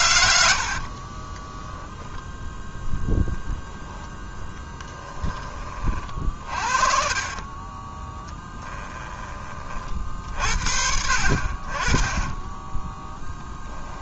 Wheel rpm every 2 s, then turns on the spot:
40, 10, 10, 40, 10, 60, 10.
0-2 6-8